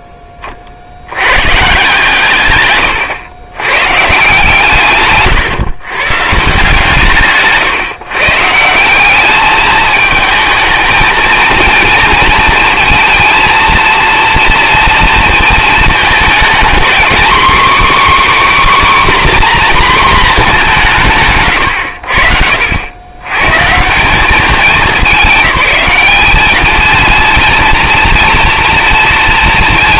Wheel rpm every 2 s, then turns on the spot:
40, 110, 150, 170, 170, 220, 220, 230, 240, 280, 200, 90, 210, 220, 230.
2-4